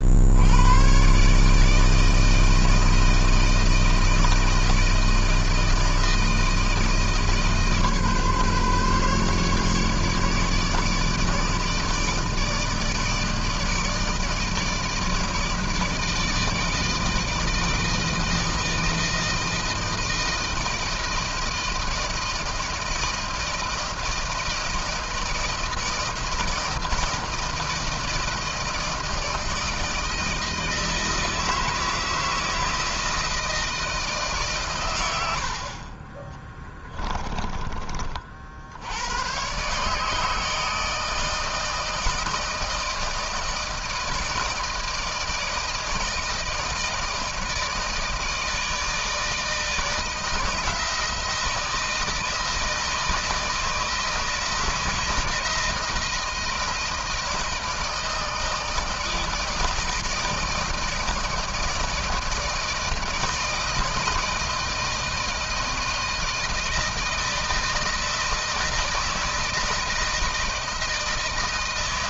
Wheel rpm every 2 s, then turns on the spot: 70, 160, 160, 160, 140, 150, 160, 160, 160, 160, 160, 160, 160, 160, 160, 160, 160, 150, 20, 50, 150, 160, 160, 160, 160, 160, 160, 160, 160, 160, 160, 160, 160, 160, 160, 160.
36-38